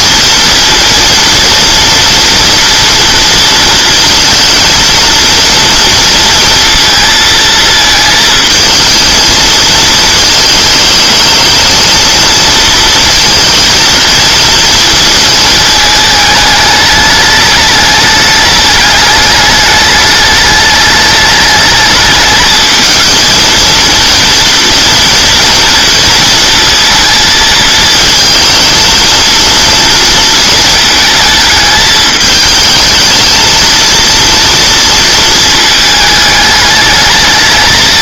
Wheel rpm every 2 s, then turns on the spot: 230, 230, 230, 230, 220, 220, 230, 230, 210, 210, 210, 220, 230, 230, 230, 220, 220, 230, 210.
none